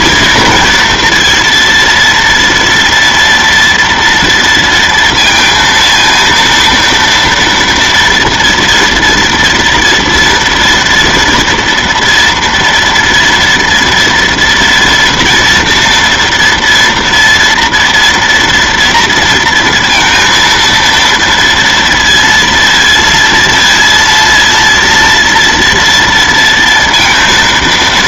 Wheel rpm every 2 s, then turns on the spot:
230, 230, 230, 230, 230, 230, 230, 240, 230, 230, 230, 230, 230, 230.
none